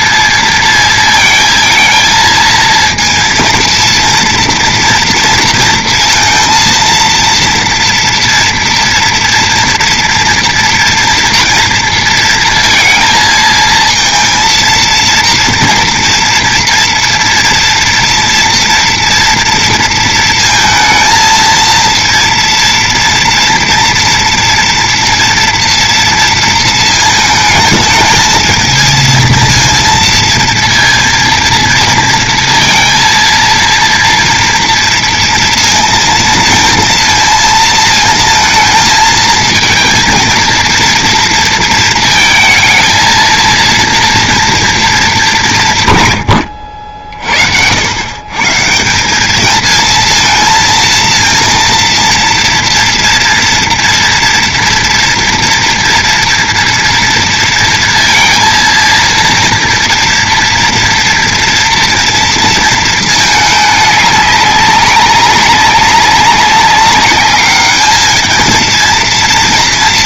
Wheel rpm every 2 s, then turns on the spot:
230, 230, 230, 230, 230, 230, 230, 230, 230, 230, 230, 230, 230, 230, 220, 230, 230, 230, 230, 220, 230, 230, 230, 80, 150, 230, 230, 230, 240, 230, 230, 230, 200, 200, 220.
none